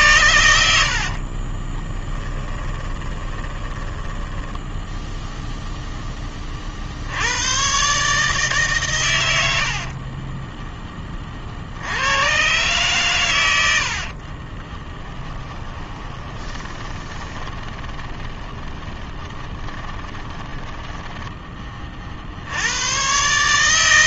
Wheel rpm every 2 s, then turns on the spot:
70, 20, 0, 50, 120, 20, 130, 10, 20, 20, 10, 110.
0-4 14-22